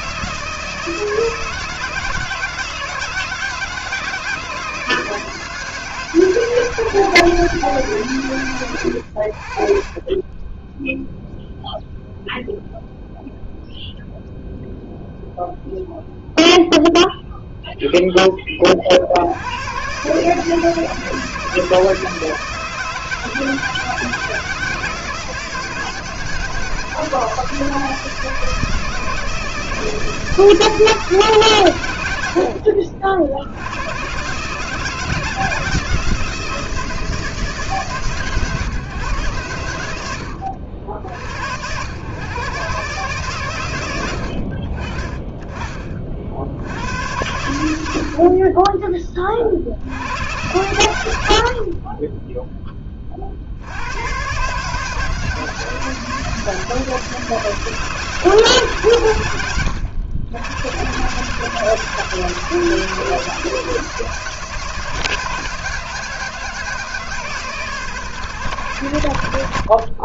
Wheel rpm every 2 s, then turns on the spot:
160, 160, 160, 160, 110, 10, 0, 0, 0, 20, 160, 160, 170, 160, 160, 160, 70, 140, 170, 130, 90, 130, 70, 70, 30, 100, 10, 130, 170, 160, 90, 160, 160, 160, 110.
none